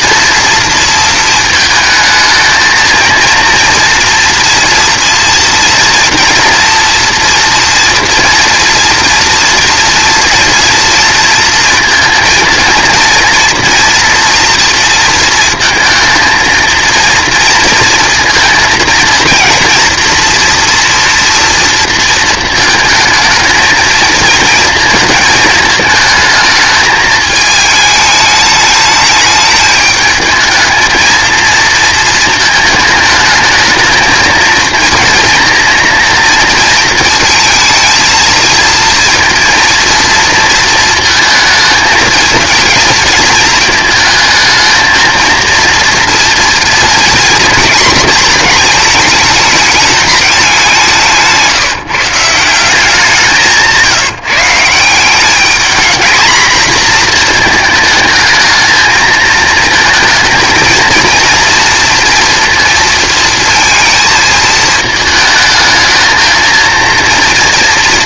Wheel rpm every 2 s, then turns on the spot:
230, 220, 230, 230, 230, 230, 230, 230, 230, 230, 230, 220, 220, 220, 210, 220, 220, 230, 230, 230, 220, 220, 230, 230, 220, 190, 180, 170, 230, 220, 220, 230, 220, 230.
none